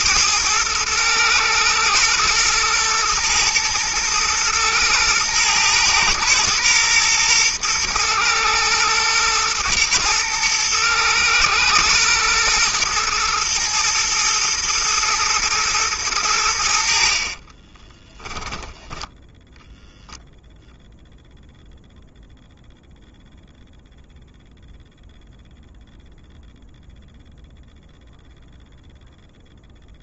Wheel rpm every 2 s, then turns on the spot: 110, 110, 120, 120, 110, 110, 120, 120, 60, 20, 0, 0, 0, 0, 0.
18-20